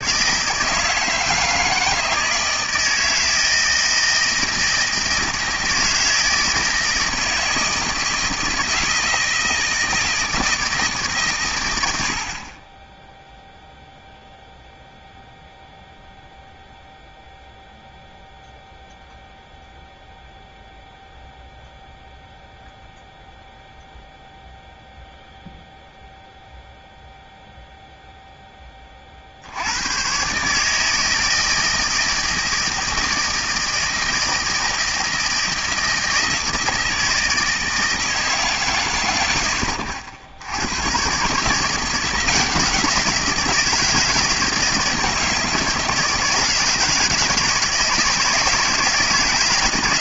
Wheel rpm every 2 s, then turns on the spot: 160, 160, 160, 160, 160, 160, 30, 0, 0, 0, 0, 0, 0, 0, 10, 140, 160, 160, 160, 140, 100, 170, 160, 160, 160.
none